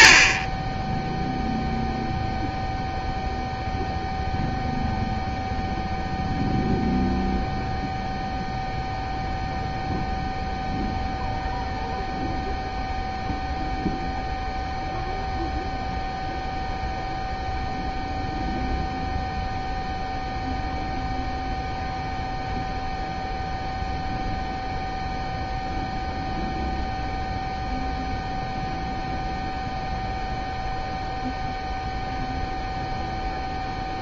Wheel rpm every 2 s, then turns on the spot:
0, 0, 0, 0, 0, 0, 0, 0, 0, 0, 0, 0, 0, 0, 0, 0, 0.
none